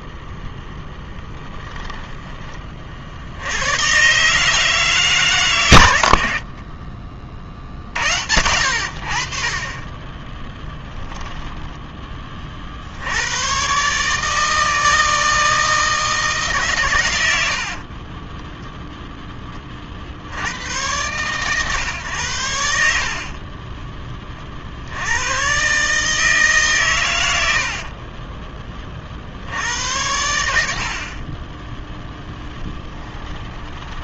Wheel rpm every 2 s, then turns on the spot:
10, 60, 150, 30, 60, 10, 80, 160, 120, 0, 110, 60, 90, 110, 40, 50, 10.
0-2 6-8 10-12 32-34